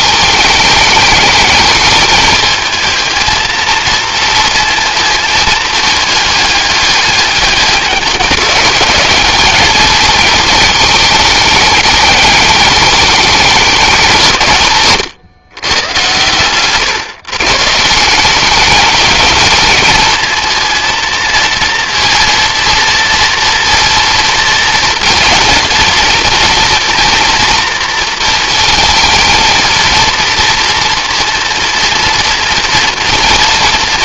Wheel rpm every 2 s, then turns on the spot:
210, 220, 220, 210, 190, 220, 210, 160, 130, 210, 230, 230, 230, 230, 220, 230, 230.
none